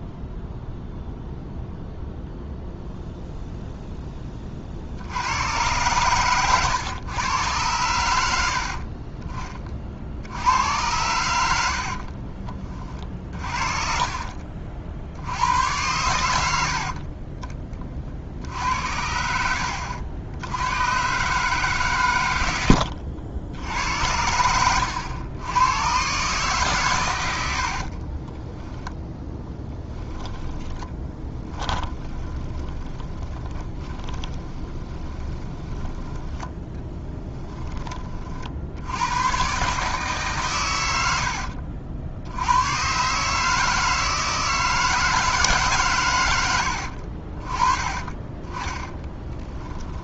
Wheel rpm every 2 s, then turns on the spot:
0, 0, 60, 110, 40, 100, 30, 50, 50, 80, 120, 90, 90, 130, 10, 10, 20, 20, 10, 90, 100, 120, 160, 80, 20.
22-24 30-38 48-50